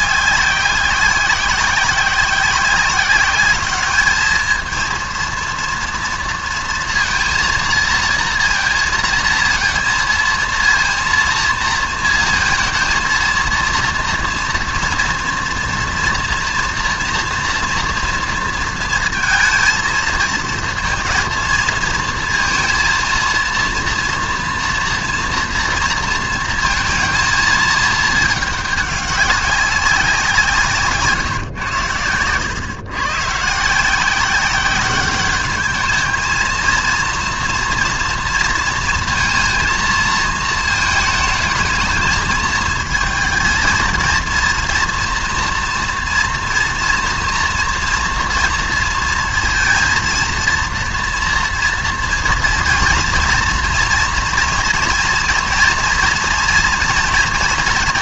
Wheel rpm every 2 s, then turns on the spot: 190, 190, 230, 230, 230, 230, 230, 230, 230, 230, 230, 230, 230, 230, 200, 160, 130, 190, 230, 230, 220, 220, 230, 230, 230, 230, 230, 230, 230.
none